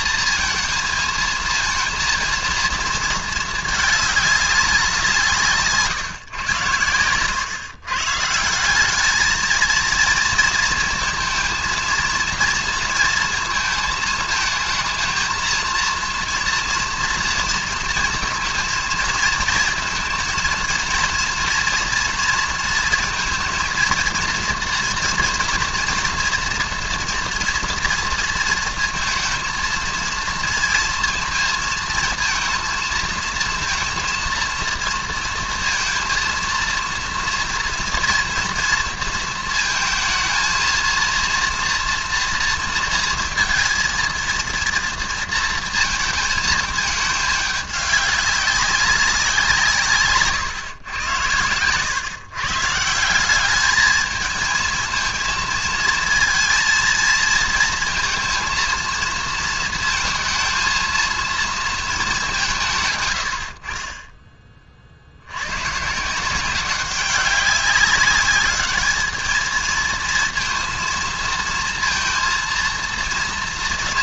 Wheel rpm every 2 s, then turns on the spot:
230, 230, 190, 120, 180, 230, 230, 220, 230, 220, 230, 230, 230, 230, 230, 230, 230, 230, 230, 230, 230, 240, 230, 220, 200, 120, 150, 220, 230, 230, 230, 160, 30, 190, 210, 230, 230.
none